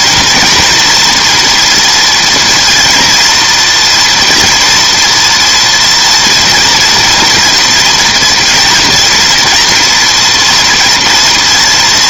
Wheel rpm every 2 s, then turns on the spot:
240, 230, 230, 230, 230, 240.
none